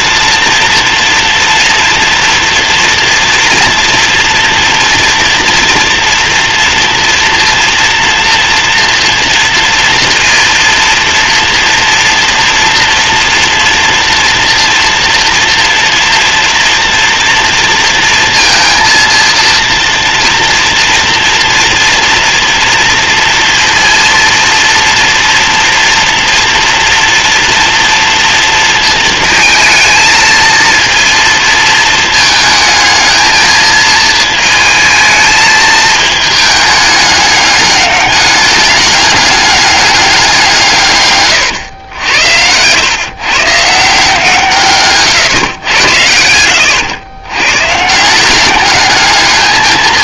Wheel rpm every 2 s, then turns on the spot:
230, 230, 240, 230, 230, 230, 230, 230, 230, 230, 230, 230, 240, 230, 230, 230, 220, 220, 210, 200, 150, 130, 130, 100, 210.
44-46